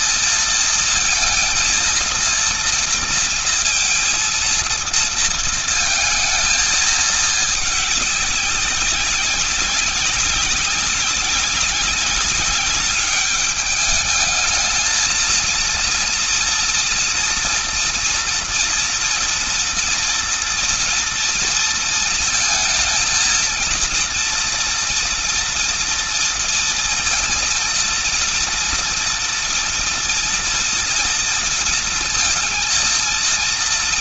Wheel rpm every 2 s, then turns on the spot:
230, 230, 230, 220, 200, 190, 200, 210, 230, 230, 230, 230, 230, 230, 230, 230, 230.
none